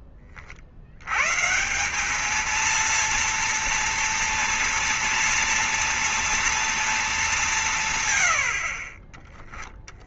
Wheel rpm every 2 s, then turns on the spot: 80, 230, 230, 220, 40.
8-10